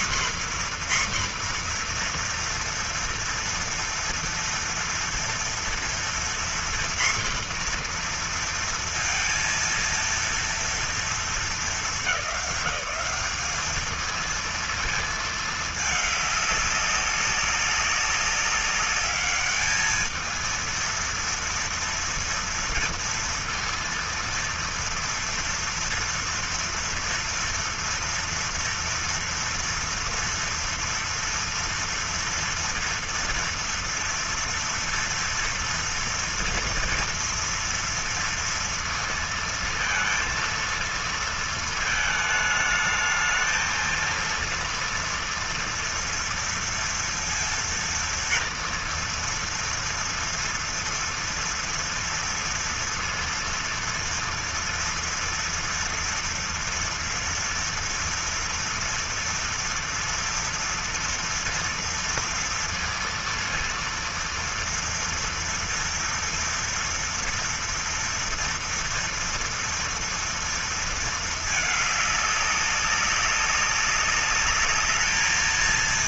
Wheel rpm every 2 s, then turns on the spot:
250, 240, 230, 240, 240, 230, 200, 220, 200, 200, 220, 240, 230, 230, 230, 230, 230, 230, 230, 230, 230, 220, 230, 230, 230, 230, 230, 230, 230, 230, 230, 230, 230, 240, 230, 230, 200, 210.
none